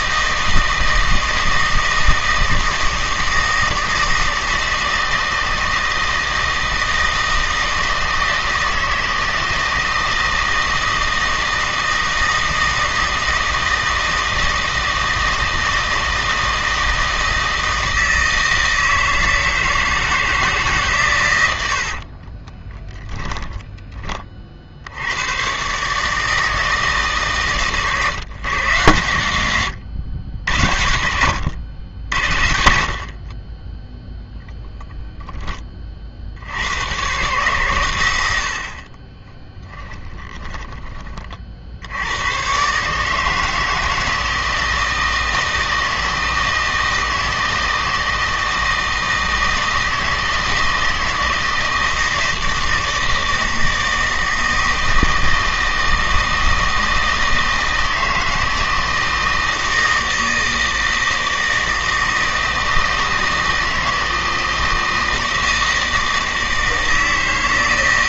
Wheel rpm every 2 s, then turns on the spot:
160, 160, 160, 160, 160, 160, 160, 160, 160, 160, 140, 10, 70, 160, 130, 90, 60, 0, 100, 40, 20, 140, 160, 160, 160, 160, 160, 160, 160, 160, 160, 160, 160, 160.
22-24